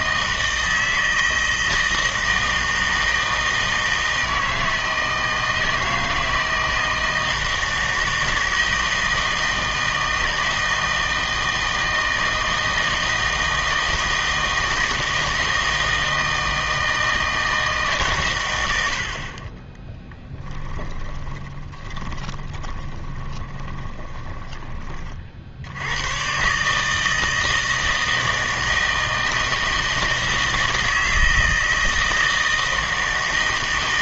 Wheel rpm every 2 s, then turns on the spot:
160, 160, 160, 160, 160, 160, 160, 160, 160, 110, 10, 20, 20, 140, 160, 160, 160.
20-24